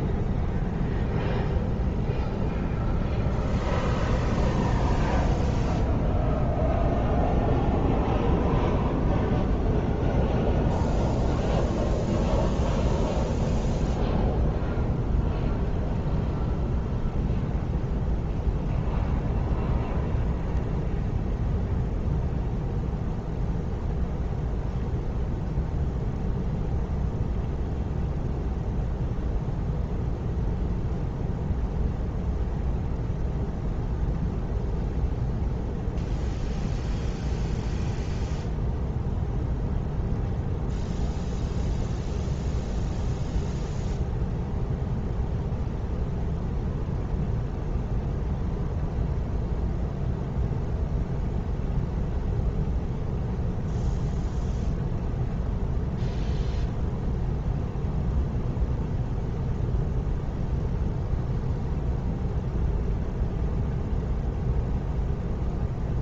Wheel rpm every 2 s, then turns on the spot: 0, 0, 0, 0, 0, 0, 0, 0, 0, 0, 0, 0, 0, 0, 0, 0, 0, 0, 0, 0, 0, 0, 0, 0, 0, 0, 0, 0, 0, 0, 0, 0, 0.
none